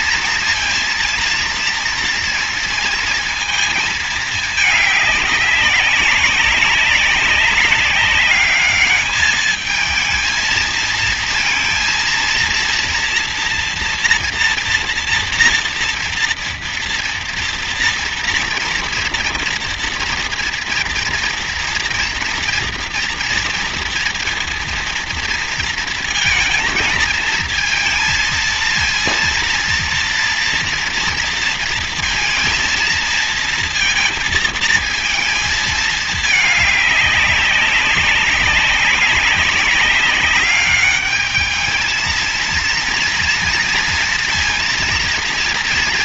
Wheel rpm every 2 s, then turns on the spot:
230, 230, 200, 200, 210, 230, 240, 230, 230, 230, 230, 230, 230, 220, 230, 230, 230, 230, 200, 190, 210, 230, 230.
none